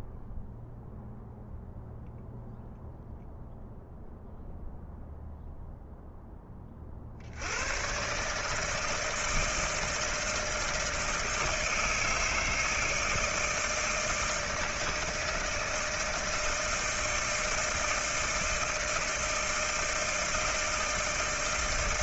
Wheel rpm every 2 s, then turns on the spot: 0, 0, 0, 30, 150, 160, 160, 160, 160, 160, 160.
none